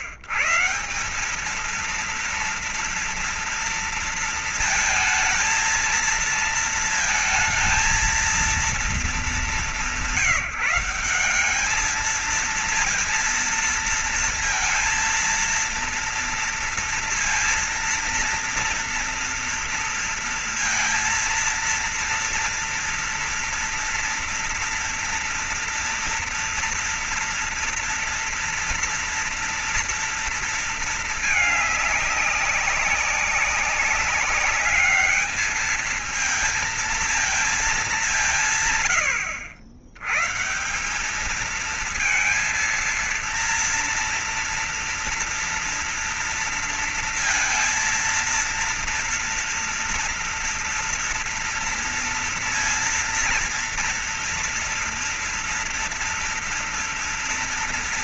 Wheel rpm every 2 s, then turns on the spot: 140, 230, 230, 230, 230, 190, 220, 230, 230, 230, 230, 230, 230, 230, 240, 230, 200, 200, 220, 170, 120, 230, 230, 230, 230, 240, 230, 230, 240.
none